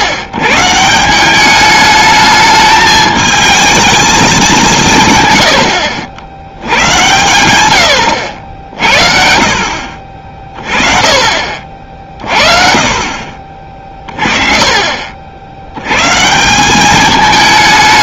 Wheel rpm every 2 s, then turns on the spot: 130, 210, 180, 100, 60, 30, 40, 40, 190.
none